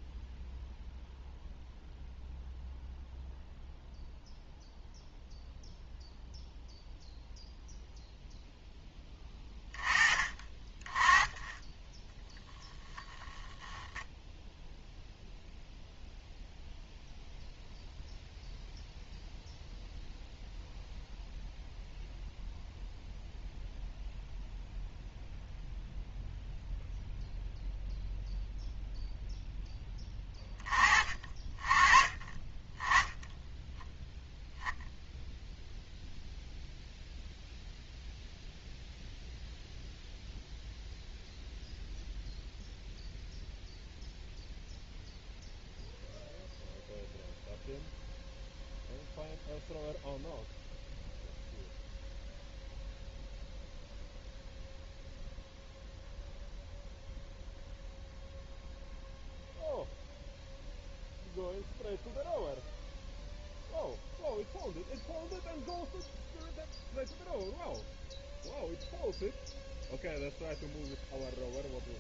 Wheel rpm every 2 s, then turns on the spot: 0, 0, 0, 0, 10, 20, 10, 0, 0, 0, 0, 0, 0, 0, 0, 30, 10, 0, 0, 0, 0, 0, 0, 0, 0, 0, 0, 0, 0, 0, 0, 0, 0, 0, 0, 0.
none